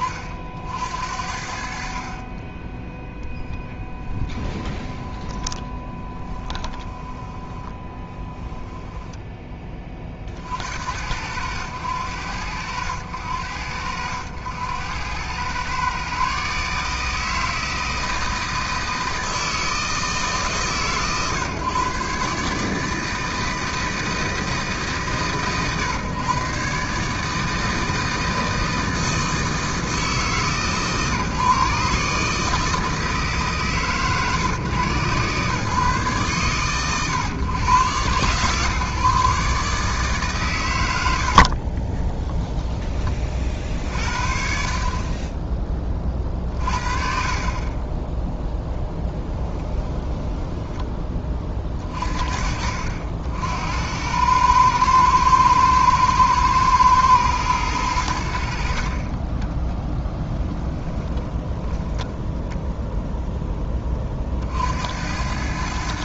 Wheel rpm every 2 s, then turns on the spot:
50, 10, 10, 10, 10, 80, 90, 100, 150, 160, 120, 150, 150, 140, 160, 150, 160, 130, 130, 140, 90, 20, 40, 40, 0, 10, 60, 110, 110, 40, 10, 0, 80.
4-10 40-42 46-48 60-62